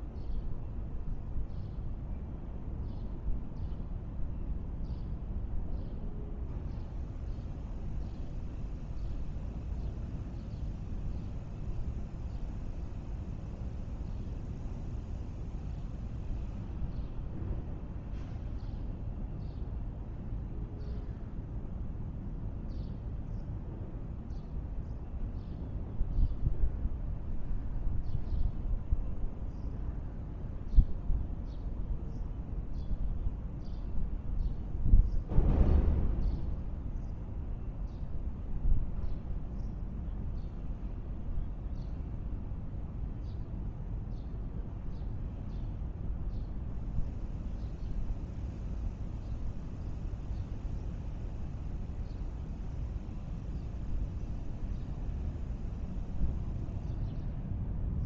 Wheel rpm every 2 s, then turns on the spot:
0, 0, 0, 0, 0, 0, 0, 0, 0, 0, 0, 0, 0, 0, 0, 0, 0, 0, 0, 0, 0, 0, 0, 0, 0, 0, 0, 0, 0.
none